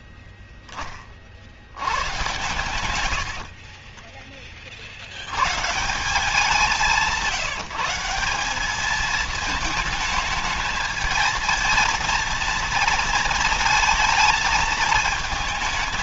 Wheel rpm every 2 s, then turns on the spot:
20, 120, 60, 180, 210, 220, 230, 220.
none